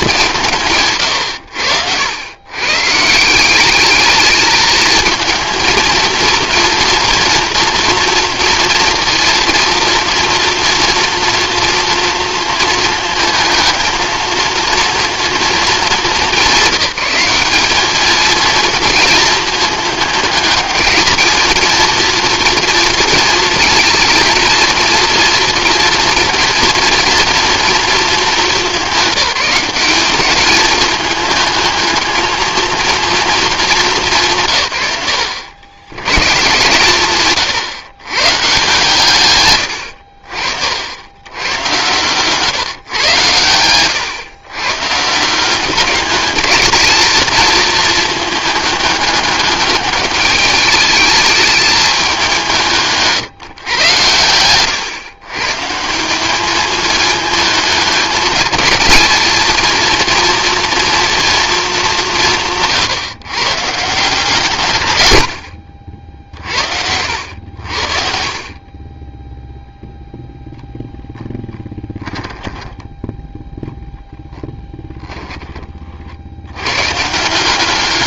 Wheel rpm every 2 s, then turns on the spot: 120, 150, 230, 230, 230, 230, 230, 230, 190, 230, 220, 230, 240, 230, 190, 210, 230, 110, 130, 130, 90, 120, 150, 230, 210, 210, 160, 120, 220, 220, 230, 160, 90, 70, 20, 0, 20, 10, 140.
none